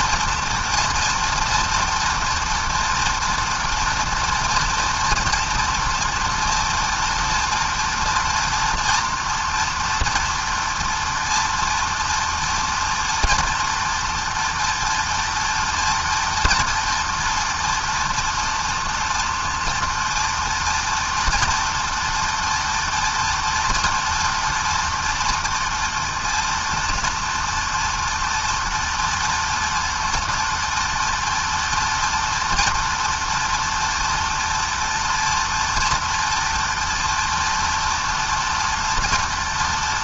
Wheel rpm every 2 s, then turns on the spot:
240, 230, 240, 230, 230, 230, 230, 230, 230, 230, 230, 230, 230, 240, 230, 230, 230, 230, 230, 240.
none